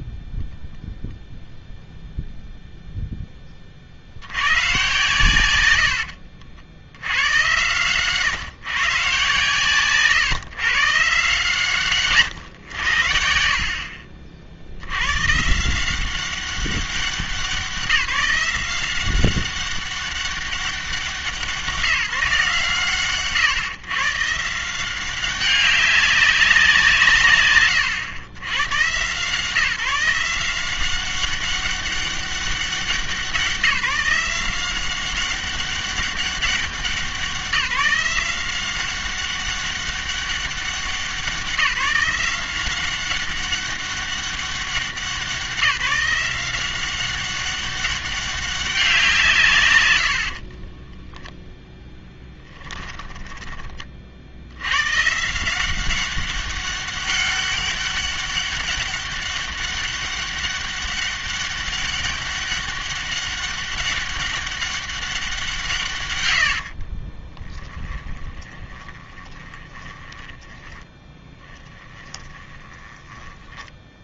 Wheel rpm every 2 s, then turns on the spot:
10, 0, 130, 70, 140, 140, 100, 80, 190, 180, 190, 150, 170, 190, 130, 180, 190, 190, 180, 180, 190, 180, 190, 180, 190, 30, 10, 100, 200, 200, 200, 200, 200, 50, 20, 20, 20.
0-2 50-54 66-74